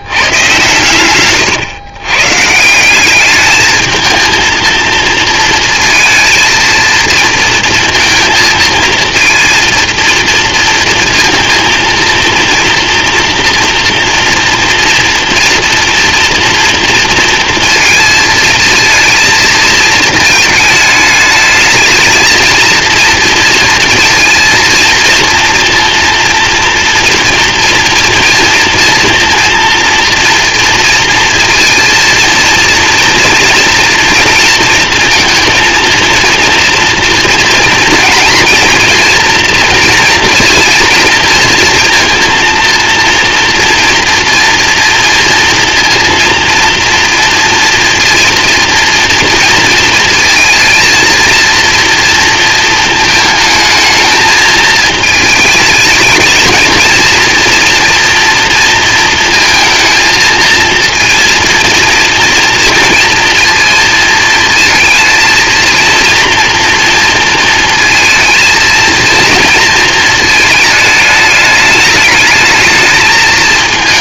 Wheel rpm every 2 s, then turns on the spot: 120, 150, 230, 230, 230, 230, 230, 240, 230, 220, 220, 230, 230, 230, 230, 240, 230, 230, 230, 230, 230, 230, 240, 240, 230, 230, 220, 220, 220, 230, 220, 230, 220, 230, 230, 220, 220.
none